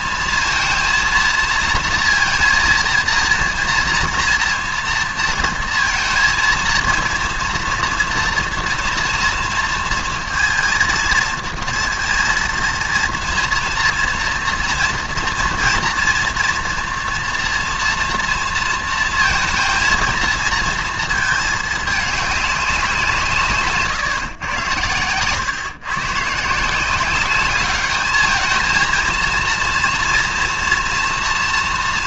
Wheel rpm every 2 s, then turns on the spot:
230, 230, 230, 230, 230, 230, 230, 230, 230, 230, 220, 200, 120, 150, 220, 240.
none